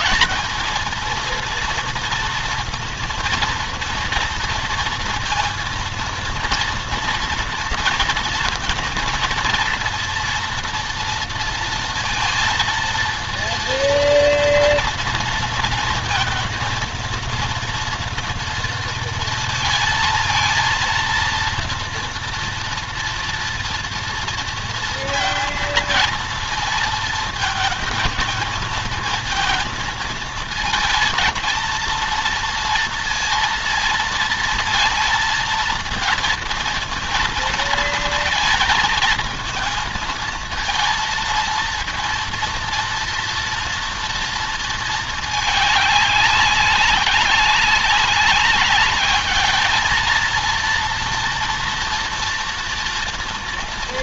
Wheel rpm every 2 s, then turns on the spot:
220, 230, 230, 230, 230, 230, 230, 230, 230, 230, 230, 230, 230, 230, 230, 230, 230, 230, 230, 220, 230, 230, 220, 200, 200, 230, 230.
none